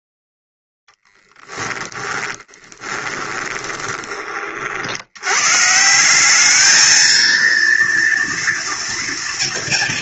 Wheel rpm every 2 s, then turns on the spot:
0, 20, 40, 200, 230.
2-4